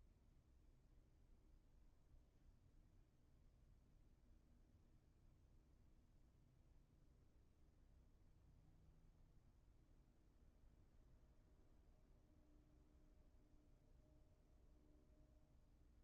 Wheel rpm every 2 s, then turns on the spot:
0, 0, 0, 0, 0, 0, 0, 0.
none